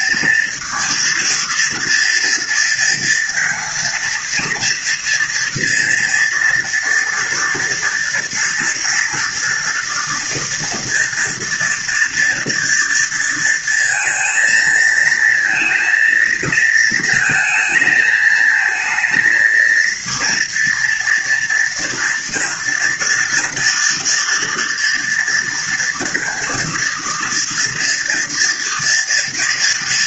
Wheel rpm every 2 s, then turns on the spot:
230, 230, 240, 230, 240, 230, 230, 220, 220, 220, 230, 230, 230, 230, 230.
none